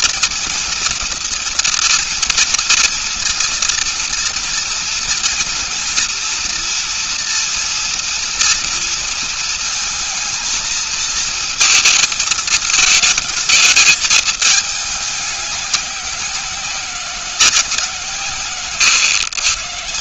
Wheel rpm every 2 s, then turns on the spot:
230, 240, 230, 230, 230, 230, 220, 210, 180, 140.
none